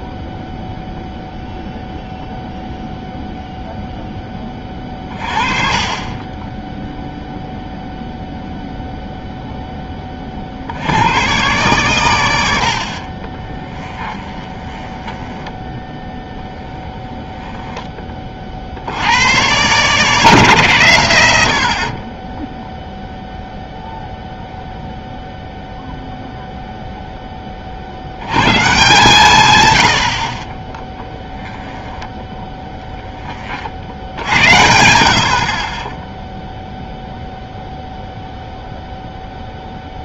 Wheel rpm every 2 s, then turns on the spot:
0, 0, 20, 10, 0, 50, 100, 20, 10, 40, 150, 10, 0, 0, 120, 40, 10, 80, 0, 0.
14-18 32-34